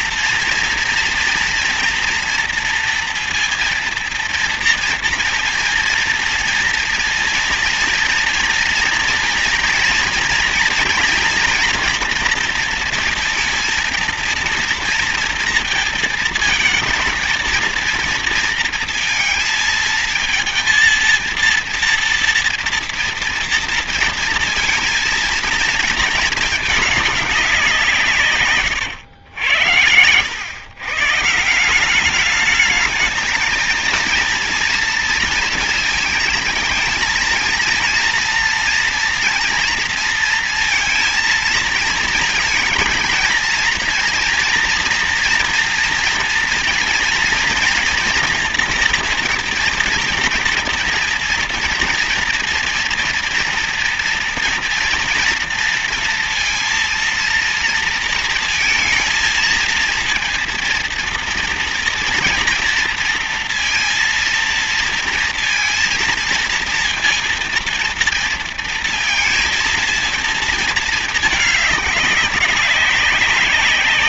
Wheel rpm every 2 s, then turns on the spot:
230, 230, 230, 230, 240, 240, 230, 230, 220, 230, 230, 230, 230, 230, 130, 110, 210, 230, 220, 230, 230, 230, 230, 230, 230, 230, 230, 240, 230, 230, 230, 230, 230, 230, 230, 220, 200.
none